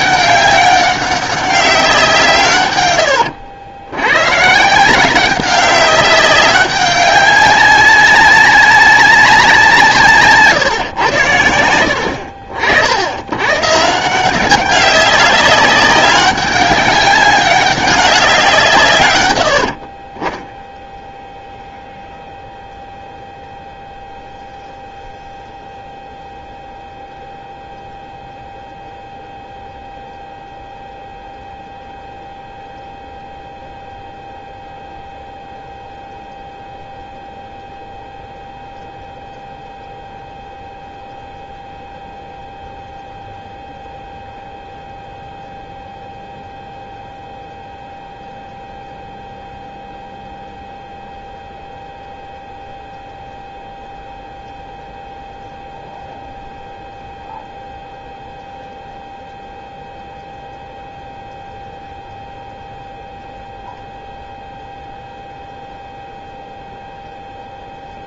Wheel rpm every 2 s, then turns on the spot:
200, 120, 160, 200, 200, 130, 70, 190, 200, 140, 0, 0, 0, 0, 0, 0, 0, 0, 0, 0, 0, 0, 0, 0, 0, 0, 0, 0, 0, 0, 0, 0, 0, 0.
none